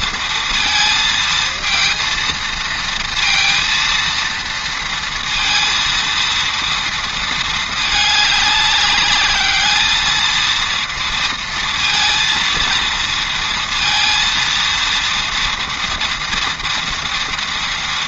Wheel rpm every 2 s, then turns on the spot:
230, 230, 230, 230, 200, 230, 230, 230, 230.
none